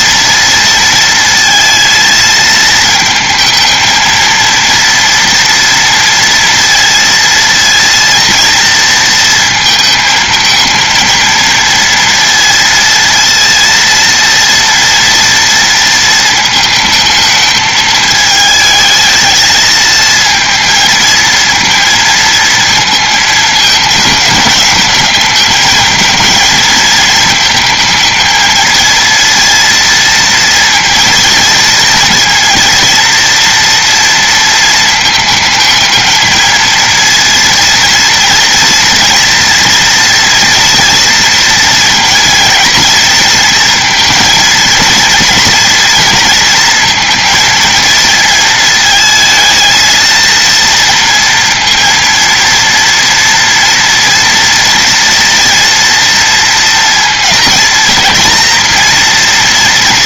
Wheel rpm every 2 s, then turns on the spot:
230, 220, 230, 230, 230, 220, 230, 230, 220, 220, 220, 220, 210, 230, 230, 230, 230, 220, 230, 230, 230, 230, 230, 230, 220, 230, 230, 240, 230, 230.
none